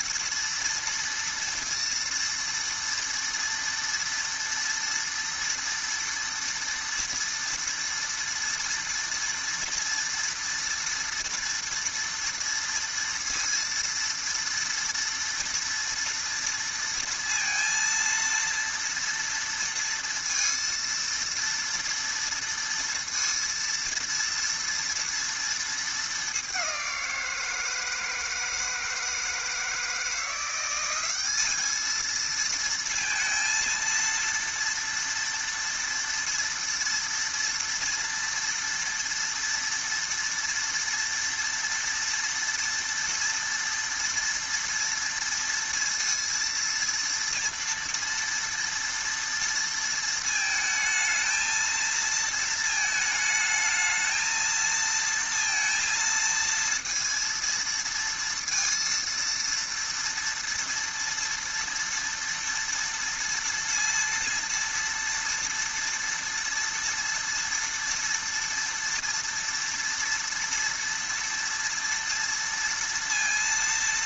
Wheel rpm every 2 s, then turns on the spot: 230, 230, 230, 230, 230, 230, 230, 230, 230, 230, 230, 230, 230, 180, 160, 200, 230, 230, 230, 230, 230, 230, 230, 230, 230, 220, 220, 230, 230, 230, 230, 230, 230, 230, 230, 230, 230.
none